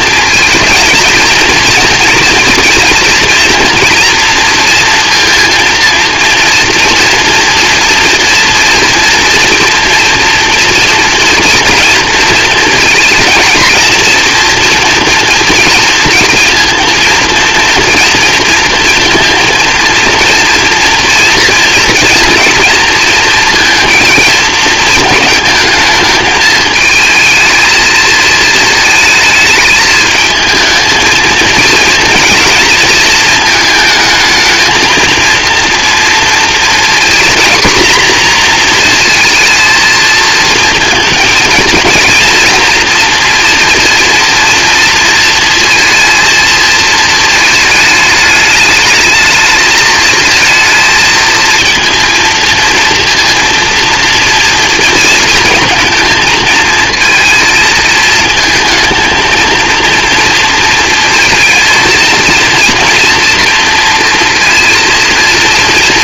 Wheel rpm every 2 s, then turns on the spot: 230, 230, 240, 230, 230, 230, 220, 230, 230, 230, 240, 230, 220, 220, 220, 220, 230, 220, 230, 240, 230, 230, 230, 230, 210, 230, 230, 230, 220, 220, 230, 230, 230.
none